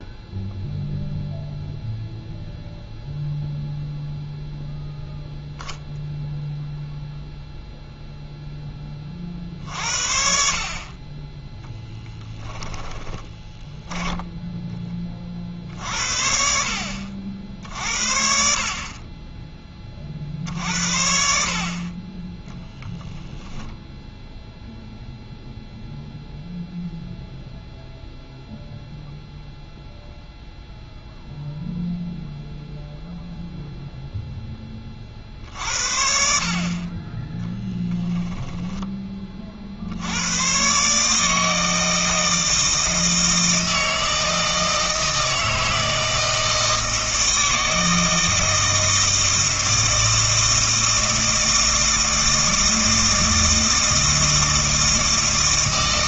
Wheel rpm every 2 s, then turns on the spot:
0, 0, 0, 0, 10, 50, 10, 10, 60, 50, 60, 10, 0, 0, 0, 0, 0, 20, 50, 10, 130, 160, 160, 160, 160, 160, 160, 160.
12-14 22-24